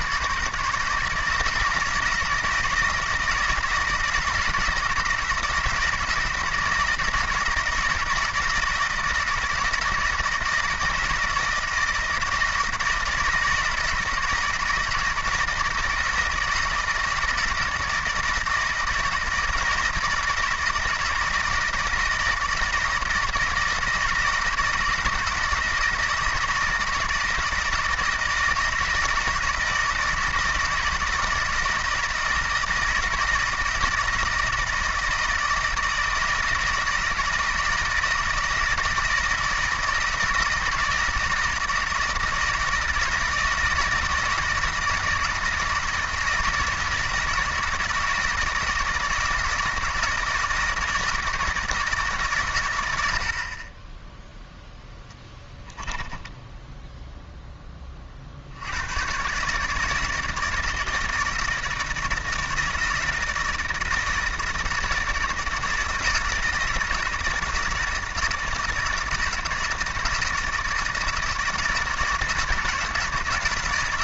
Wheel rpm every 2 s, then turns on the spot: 150, 170, 160, 160, 160, 160, 160, 160, 160, 160, 160, 160, 160, 160, 160, 160, 160, 170, 160, 160, 160, 160, 160, 160, 160, 160, 120, 0, 10, 80, 160, 160, 160, 160, 160, 160, 160.
56-58